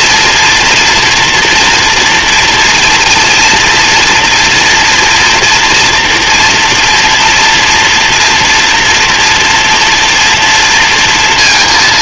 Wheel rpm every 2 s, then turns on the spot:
240, 230, 230, 230, 240, 230.
none